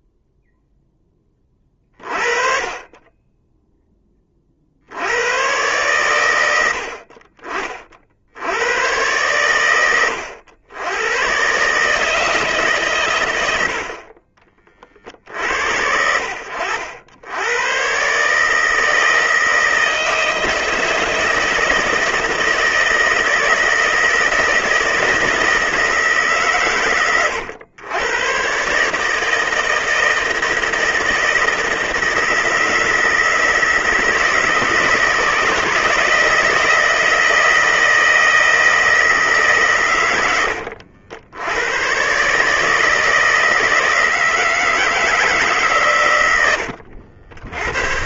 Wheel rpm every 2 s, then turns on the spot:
10, 20, 80, 60, 100, 110, 120, 40, 80, 160, 160, 170, 160, 120, 140, 160, 170, 160, 160, 160, 80, 160, 160, 80.
none